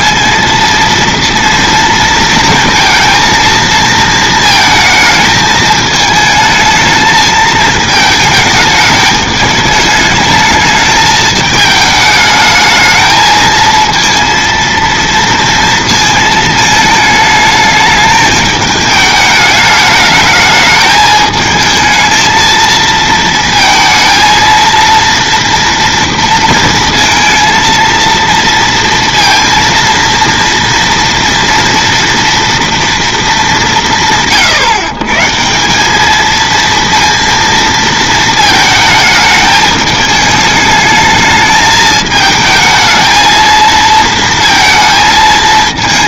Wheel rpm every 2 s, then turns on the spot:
230, 230, 220, 220, 210, 210, 220, 230, 220, 210, 220, 220, 230, 230, 230, 230, 230, 140, 230, 220, 210, 220, 220.
none